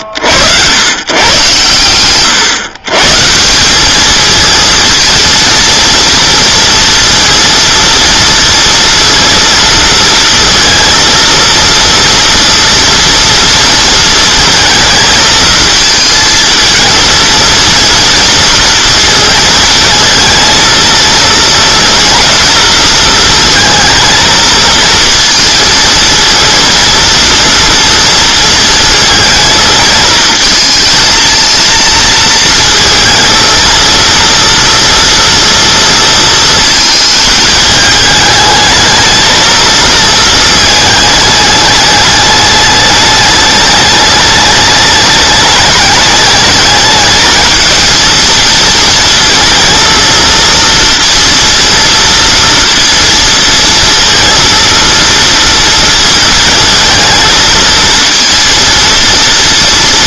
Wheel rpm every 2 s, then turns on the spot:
100, 120, 230, 230, 230, 230, 230, 220, 220, 230, 230, 230, 230, 230, 230, 230, 230, 240, 230, 220, 220, 210, 210, 220, 220, 230, 230, 230, 220, 230.
none